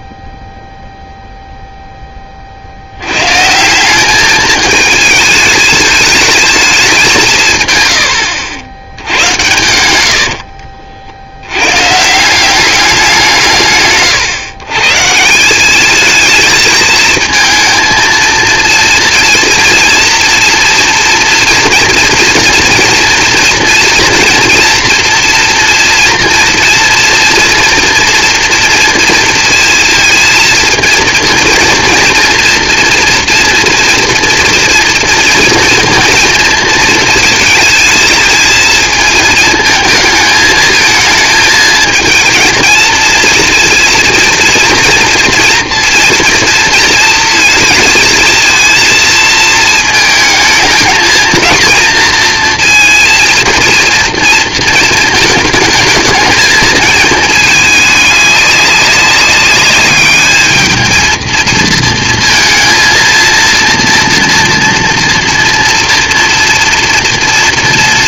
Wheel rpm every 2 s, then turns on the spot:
0, 80, 220, 180, 90, 60, 190, 150, 220, 230, 230, 230, 230, 230, 240, 230, 230, 230, 230, 220, 220, 230, 230, 230, 230, 220, 230, 230, 220, 200, 220, 230, 230, 230.
none